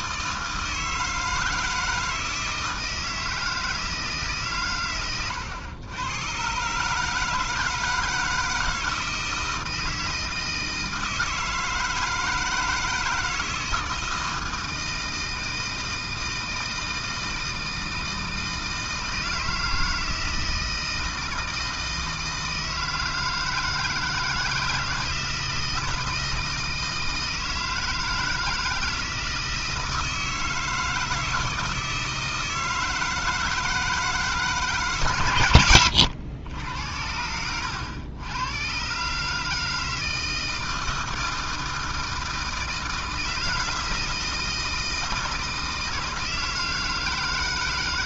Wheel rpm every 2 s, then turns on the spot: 160, 160, 130, 140, 160, 160, 160, 160, 160, 160, 160, 160, 160, 160, 160, 160, 160, 150, 80, 110, 160, 160, 160, 160.
none